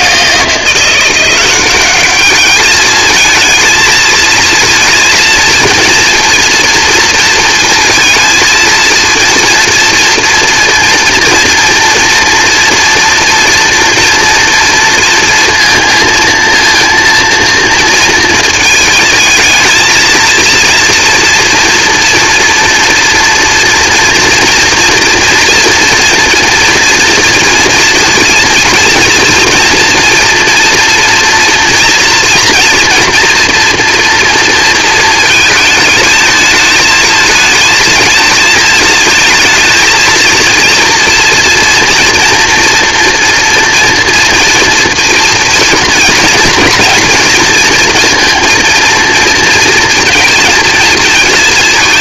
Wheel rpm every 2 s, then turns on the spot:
170, 210, 230, 230, 220, 230, 240, 230, 230, 220, 230, 240, 240, 240, 230, 230, 230, 230, 220, 220, 230, 230, 230, 230, 230, 220.
none